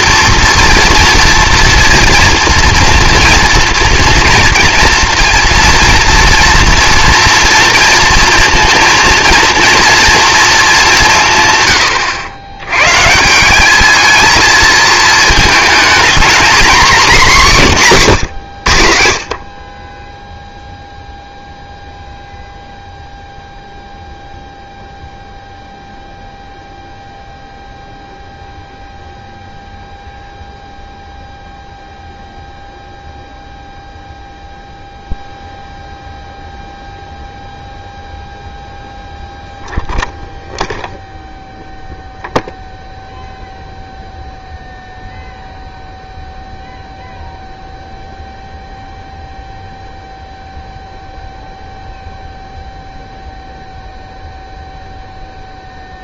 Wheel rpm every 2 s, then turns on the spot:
230, 230, 230, 230, 230, 210, 110, 220, 240, 80, 0, 0, 0, 0, 0, 0, 0, 0, 0, 0, 0, 0, 0, 0, 0, 0, 0, 0.
none